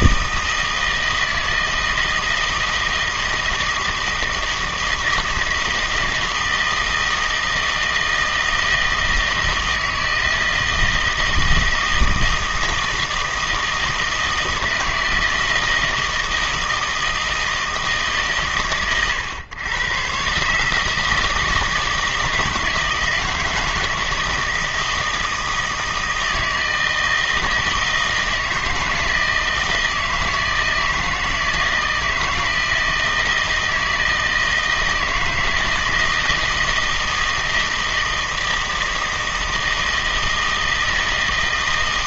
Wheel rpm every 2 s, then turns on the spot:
160, 160, 160, 160, 160, 160, 160, 160, 160, 120, 150, 160, 160, 160, 160, 160, 170, 160, 160, 160, 160.
none